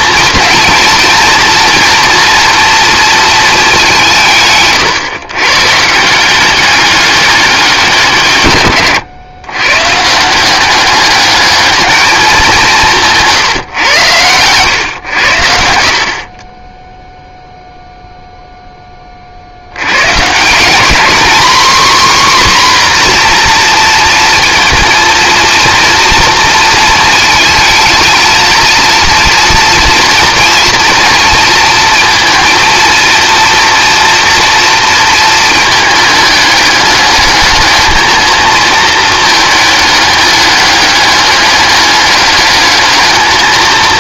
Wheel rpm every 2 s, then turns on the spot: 230, 230, 130, 200, 120, 200, 160, 100, 0, 30, 230, 260, 230, 230, 230, 230, 230, 230, 210, 220, 210, 210.
none